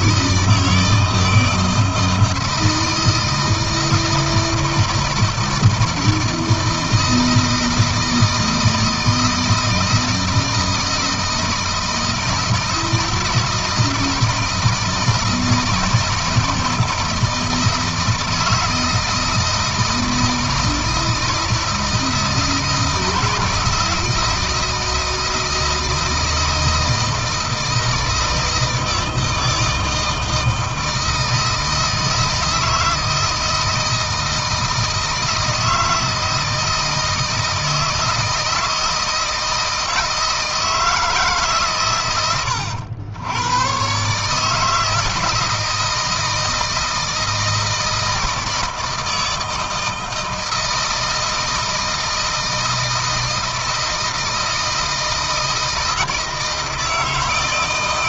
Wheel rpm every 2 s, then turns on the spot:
160, 160, 160, 160, 160, 160, 160, 160, 160, 160, 160, 160, 160, 160, 160, 160, 160, 160, 160, 160, 160, 90, 150, 160, 160, 160, 160, 160, 160.
none